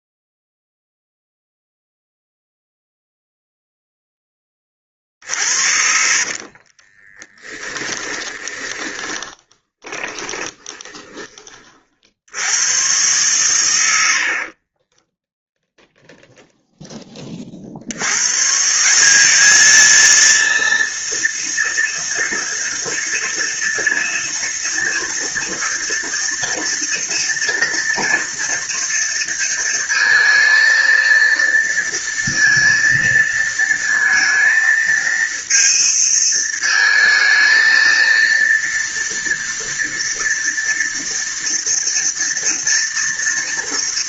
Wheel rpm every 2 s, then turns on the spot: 0, 0, 40, 20, 10, 20, 120, 10, 10, 190, 230, 230, 230, 230, 230, 230, 230, 230, 220, 230, 230, 230.
4-10 14-16